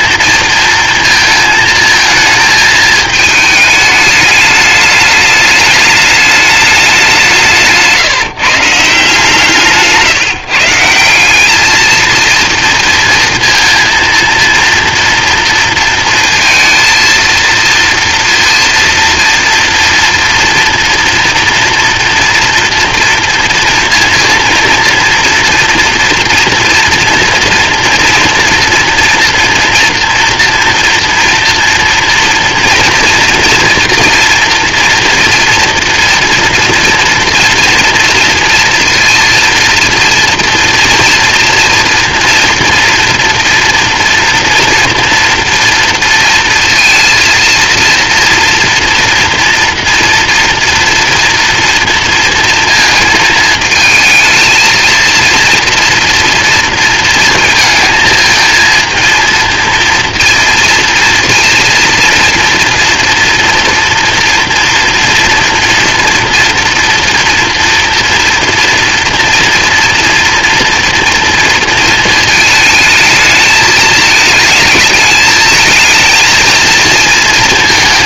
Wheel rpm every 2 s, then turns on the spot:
230, 220, 210, 200, 150, 160, 230, 230, 230, 230, 240, 230, 230, 240, 230, 240, 230, 230, 230, 230, 240, 230, 230, 230, 230, 240, 230, 230, 230, 230, 230, 230, 230, 230, 230, 230, 220, 220, 230.
none